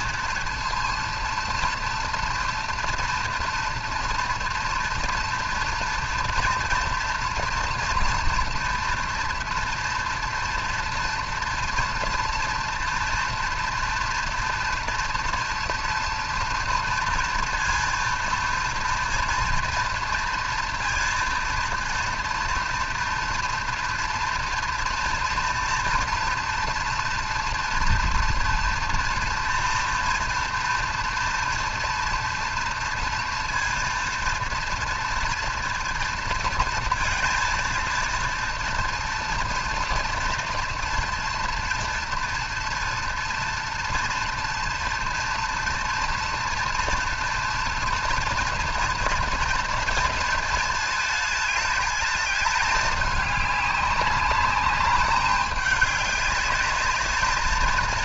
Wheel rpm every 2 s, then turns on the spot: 230, 230, 230, 230, 230, 230, 240, 230, 230, 230, 230, 230, 230, 240, 230, 230, 230, 230, 230, 230, 240, 230, 240, 230, 230, 230, 210, 190, 210.
none